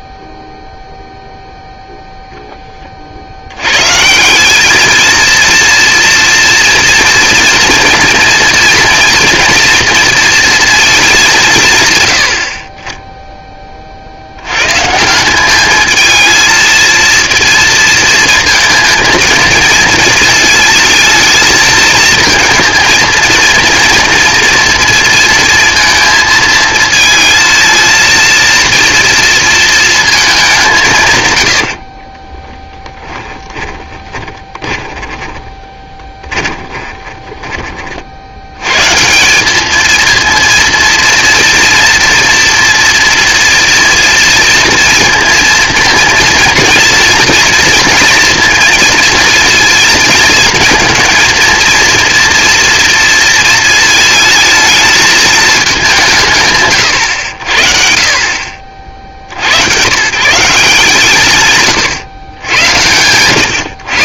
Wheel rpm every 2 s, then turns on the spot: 0, 10, 200, 230, 240, 230, 70, 110, 220, 230, 230, 230, 230, 220, 230, 190, 10, 20, 20, 100, 230, 240, 230, 230, 230, 220, 230, 220, 140, 50, 160, 100.
32-38